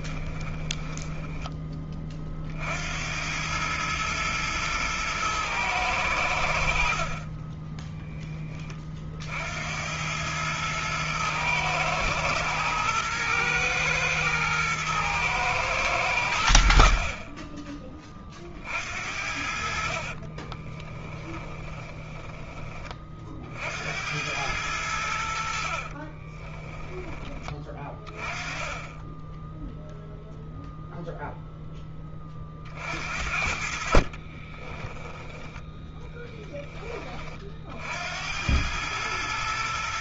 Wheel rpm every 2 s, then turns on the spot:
10, 90, 110, 50, 50, 110, 110, 110, 50, 60, 20, 40, 80, 20, 10, 0, 50, 10, 30, 100.
0-2 20-22 32-36